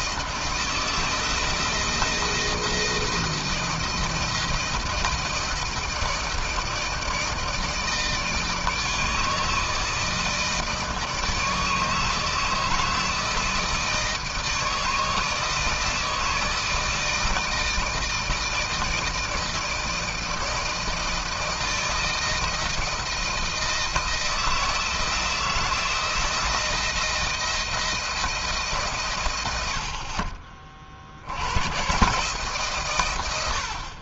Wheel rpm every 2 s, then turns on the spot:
160, 170, 160, 160, 160, 160, 160, 160, 160, 160, 160, 160, 160, 160, 150, 50, 130.
none